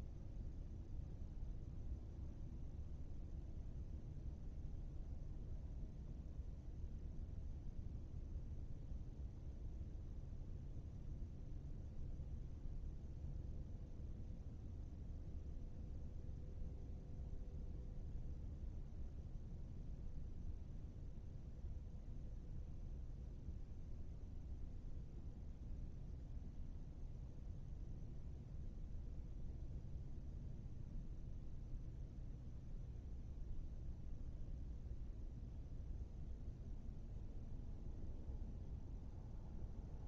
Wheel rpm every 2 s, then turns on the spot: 0, 0, 0, 0, 0, 0, 0, 0, 0, 0, 0, 0, 0, 0, 0, 0, 0, 0, 0, 0.
none